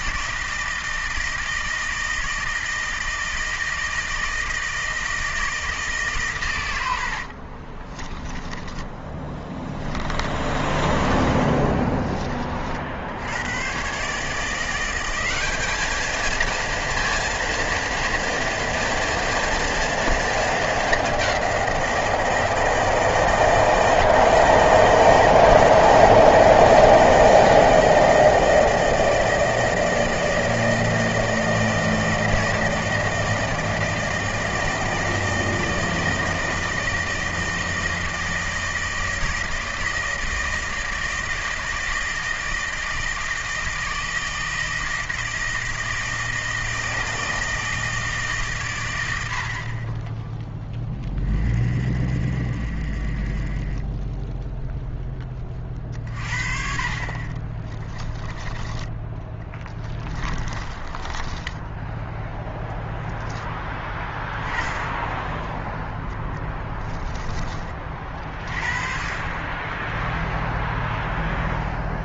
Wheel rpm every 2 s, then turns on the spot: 160, 160, 160, 110, 20, 20, 50, 170, 230, 230, 220, 160, 160, 160, 160, 160, 160, 160, 160, 160, 160, 160, 160, 160, 130, 10, 40, 0, 50, 10, 20, 0, 10, 10, 40, 0.
10-12 58-62 66-68